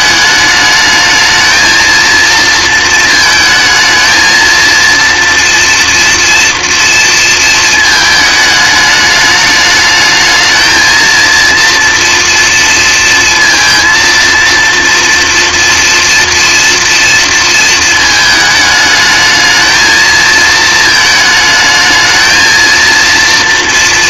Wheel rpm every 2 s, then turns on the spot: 220, 230, 230, 230, 210, 220, 230, 230, 230, 220, 220, 230.
none